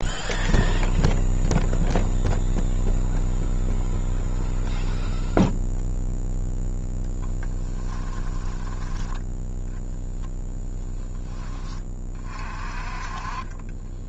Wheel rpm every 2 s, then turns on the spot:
0, 0, 0, 0, 10, 20, 30.
8-10